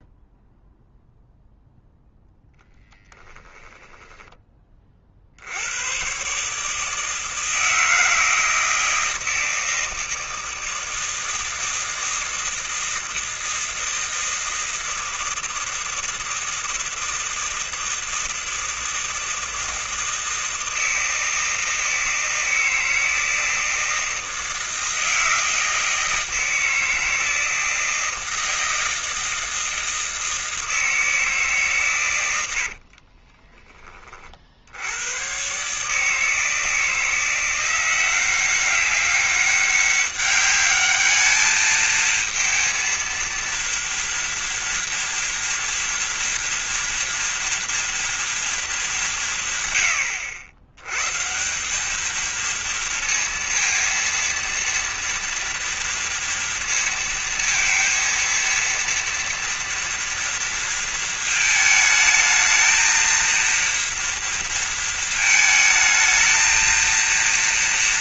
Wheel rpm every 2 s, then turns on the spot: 0, 10, 50, 160, 160, 160, 160, 160, 160, 160, 160, 160, 160, 160, 160, 160, 40, 100, 160, 200, 210, 230, 240, 230, 190, 130, 230, 230, 230, 230, 230, 230, 220, 230.
32-34